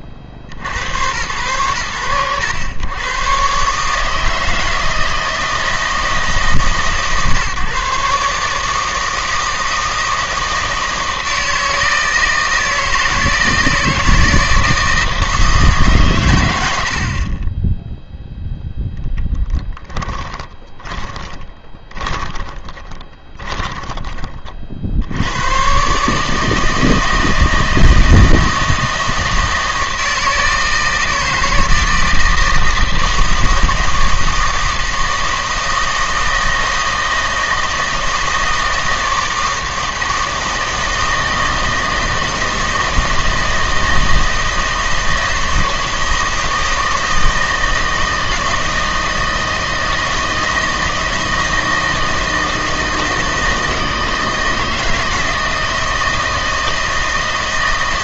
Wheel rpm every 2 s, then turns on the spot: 30, 100, 160, 150, 160, 160, 160, 160, 80, 0, 20, 20, 50, 160, 160, 160, 160, 160, 160, 160, 160, 160, 160, 160, 160, 160, 160, 160, 160.
20-24